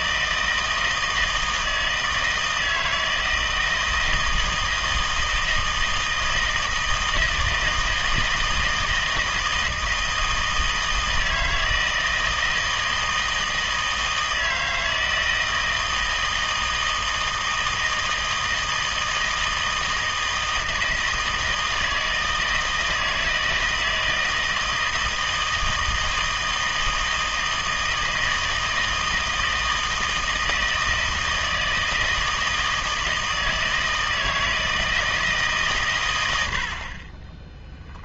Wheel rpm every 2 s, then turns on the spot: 160, 160, 160, 160, 160, 160, 160, 160, 160, 160, 160, 160, 160, 160, 160, 160, 160, 160, 70.
36-38